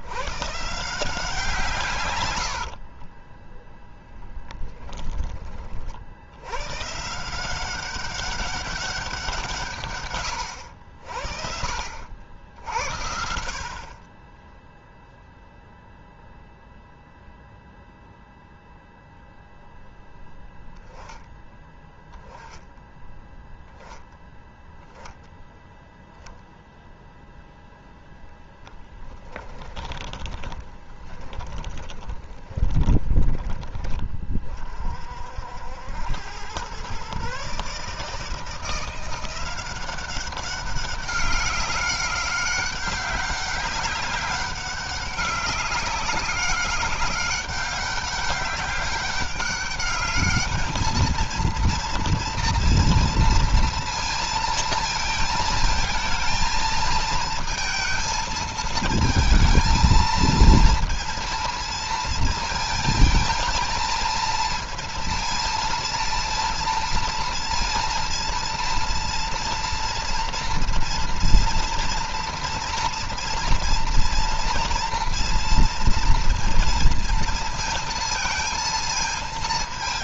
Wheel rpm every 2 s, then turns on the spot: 150, 50, 10, 130, 190, 80, 80, 0, 0, 0, 20, 10, 0, 0, 10, 20, 20, 50, 120, 170, 190, 200, 200, 190, 200, 220, 230, 230, 230, 220, 230, 230, 230, 230, 230, 230, 230, 230, 230, 230.
2-4 28-34